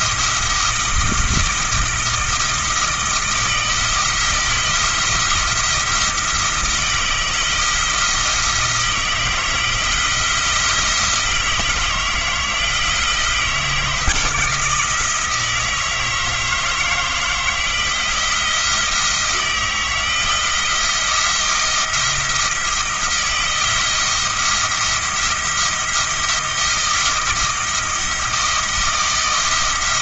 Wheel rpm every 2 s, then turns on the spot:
170, 160, 170, 170, 170, 170, 160, 160, 160, 170, 170, 170, 170, 170, 160.
none